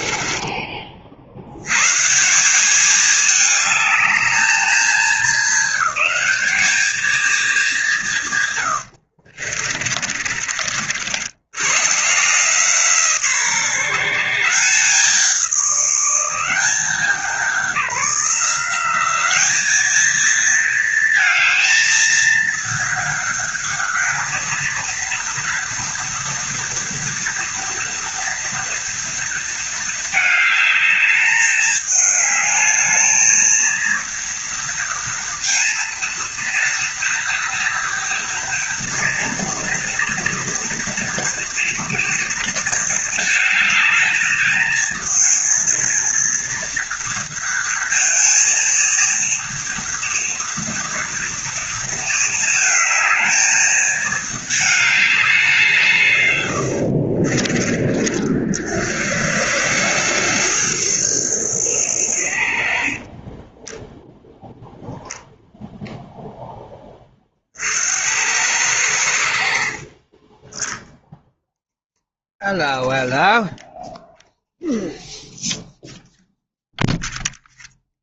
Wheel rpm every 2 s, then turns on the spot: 30, 200, 220, 220, 100, 50, 160, 170, 190, 190, 220, 220, 230, 230, 230, 210, 220, 230, 230, 240, 230, 220, 220, 230, 230, 230, 220, 210, 70, 50, 110, 50, 0, 20, 90, 0, 0, 0, 0.
8-10 56-58 62-64